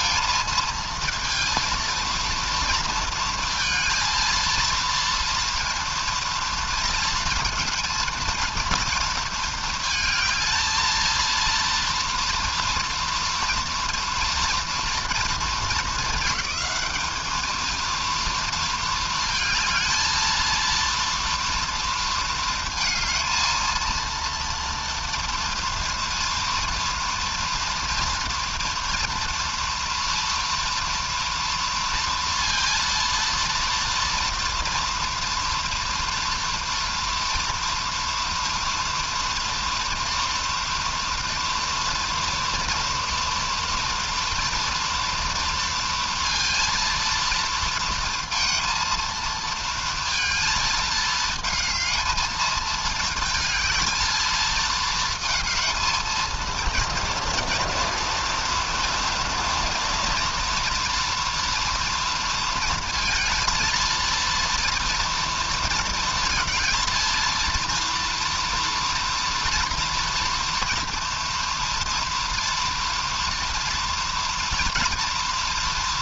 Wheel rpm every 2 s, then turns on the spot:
220, 230, 230, 230, 230, 220, 230, 240, 210, 230, 230, 230, 230, 230, 230, 230, 230, 230, 240, 230, 230, 230, 230, 230, 230, 220, 220, 220, 230, 230, 230, 230, 230, 230, 230, 240, 230, 230.
none